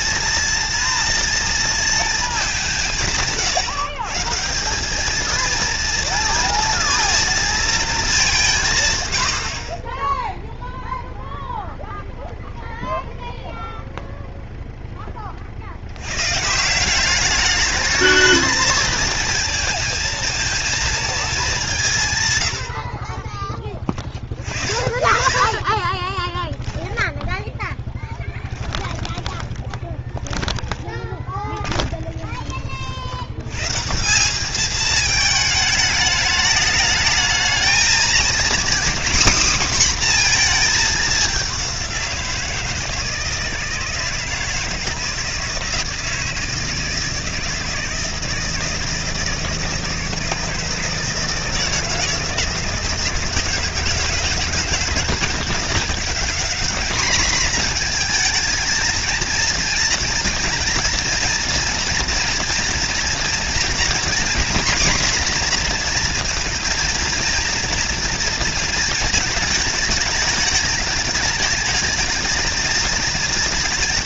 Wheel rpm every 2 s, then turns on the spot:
230, 190, 190, 230, 130, 0, 0, 10, 180, 220, 220, 70, 50, 10, 20, 10, 60, 210, 210, 260, 210, 160, 160, 160, 160, 170, 160, 160, 220, 230, 230, 230, 240, 230, 230, 210, 220.
28-32